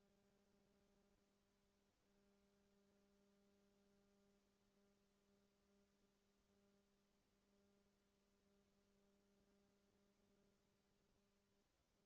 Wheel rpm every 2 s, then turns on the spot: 0, 0, 0, 0, 0, 0.
none